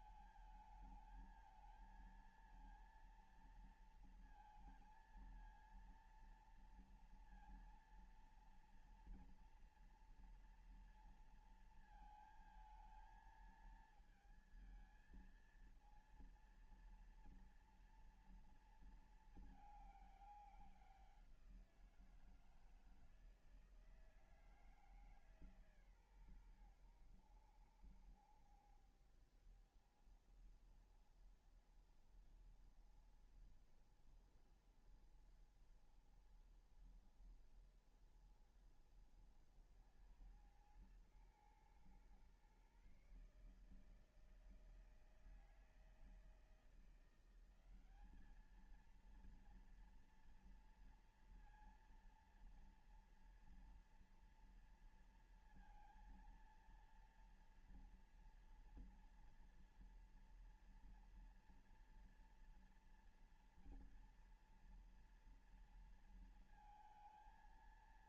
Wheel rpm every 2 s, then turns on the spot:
220, 230, 230, 230, 230, 230, 230, 220, 230, 230, 200, 170, 160, 130, 70, 70, 70, 70, 70, 70, 90, 120, 150, 160, 200, 230, 230, 230, 230, 230, 230, 230, 230, 230.
none